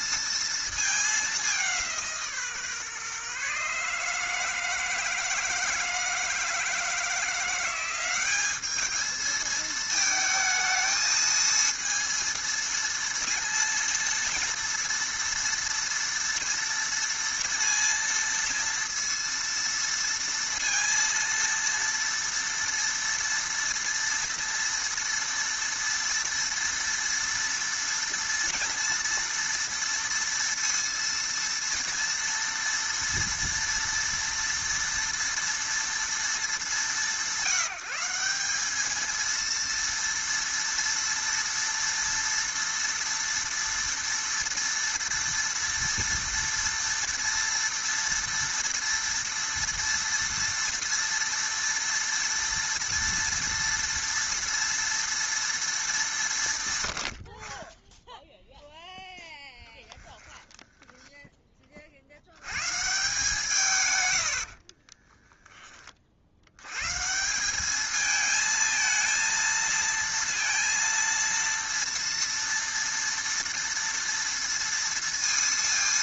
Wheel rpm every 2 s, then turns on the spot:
220, 140, 160, 160, 210, 220, 230, 230, 230, 230, 230, 230, 240, 230, 230, 230, 230, 230, 200, 200, 230, 230, 230, 230, 230, 230, 230, 230, 140, 0, 10, 120, 40, 110, 220, 230, 230, 230.
60-62 64-66